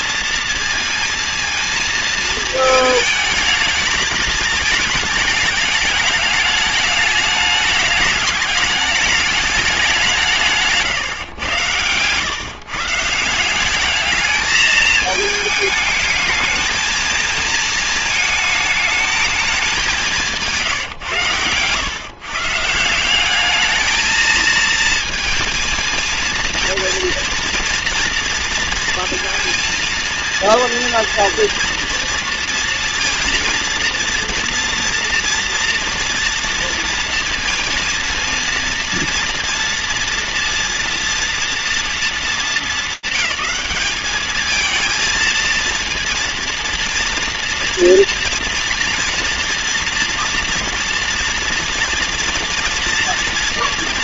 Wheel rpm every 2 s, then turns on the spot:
230, 220, 220, 210, 210, 160, 140, 220, 220, 220, 150, 170, 220, 230, 240, 230, 230, 240, 240, 230, 230, 210, 210, 230, 230, 230, 230.
none